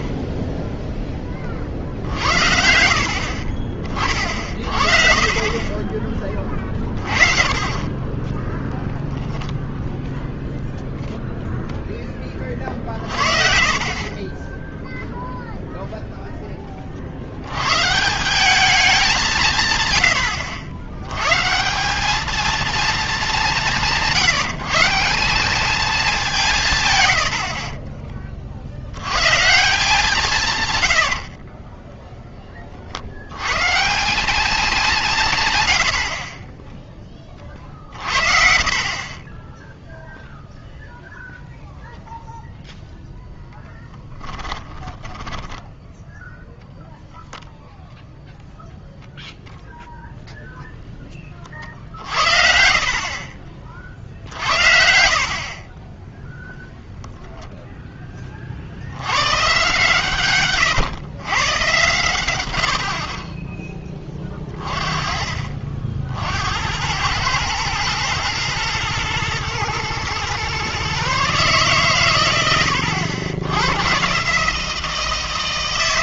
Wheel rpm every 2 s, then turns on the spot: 10, 90, 60, 30, 0, 0, 40, 10, 20, 200, 90, 220, 170, 140, 60, 120, 30, 200, 20, 60, 0, 0, 10, 0, 0, 0, 60, 70, 0, 70, 120, 80, 30, 90, 120, 130, 100, 160.
38-40 44-46 54-56 60-62